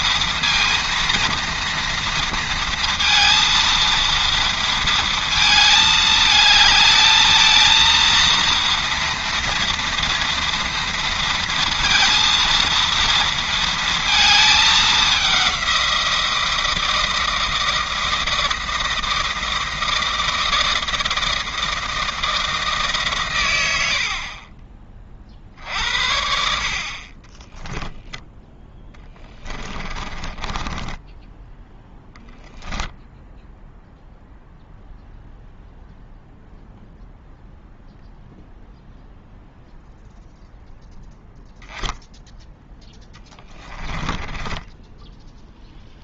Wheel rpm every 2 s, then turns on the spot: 230, 230, 230, 220, 230, 230, 230, 210, 160, 160, 160, 150, 30, 40, 10, 10, 0, 0, 0, 0, 0, 10, 10.
30-32 42-46